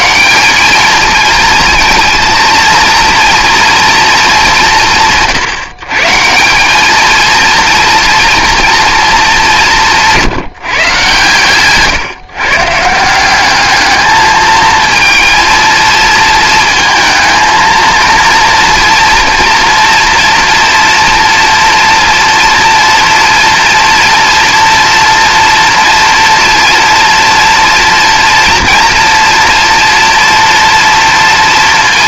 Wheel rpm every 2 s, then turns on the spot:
210, 230, 180, 210, 230, 150, 150, 230, 230, 240, 230, 230, 240, 230, 230, 230.
none